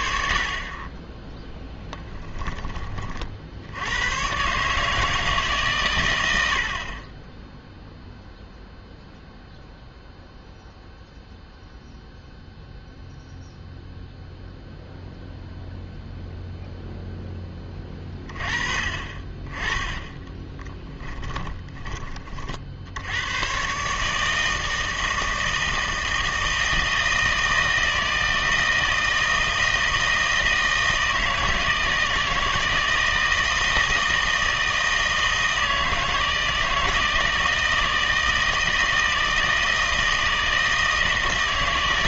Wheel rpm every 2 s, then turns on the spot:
40, 20, 140, 70, 0, 0, 0, 0, 0, 30, 10, 50, 160, 160, 160, 160, 160, 160, 160, 160, 160.
20-22